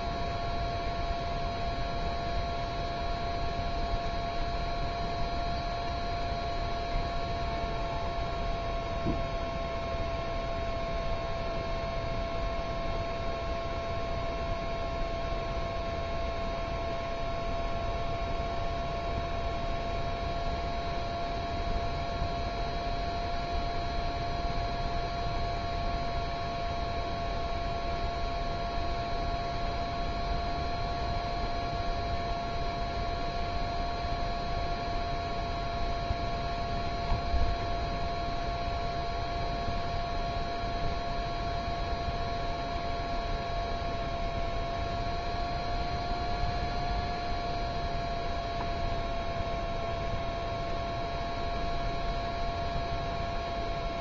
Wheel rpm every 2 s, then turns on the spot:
0, 0, 0, 0, 0, 0, 0, 0, 0, 0, 0, 0, 0, 0, 0, 0, 0, 0, 0, 0, 0, 0, 0, 0, 0, 0, 0.
none